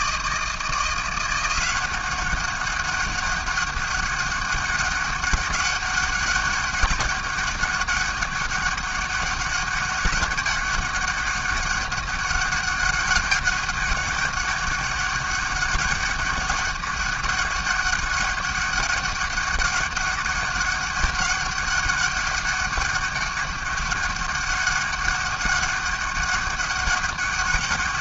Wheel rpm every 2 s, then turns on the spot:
170, 200, 200, 200, 200, 200, 200, 200, 200, 200, 200, 200, 200, 200.
none